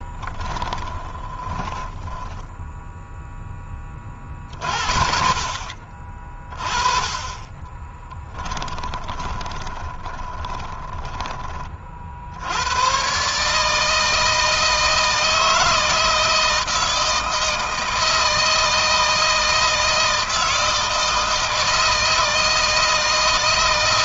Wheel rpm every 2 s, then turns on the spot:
20, 0, 50, 20, 20, 10, 120, 160, 160, 160, 160, 160.
0-2 8-10